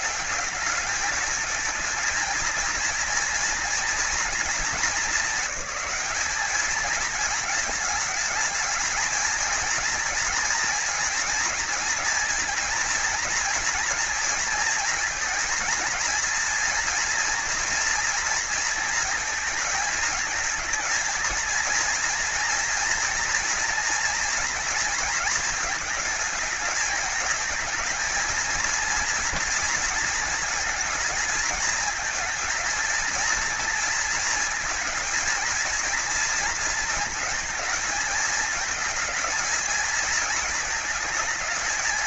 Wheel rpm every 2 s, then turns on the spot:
210, 230, 230, 220, 210, 220, 230, 230, 230, 230, 220, 230, 220, 220, 230, 230, 230, 220, 230, 220, 220.
none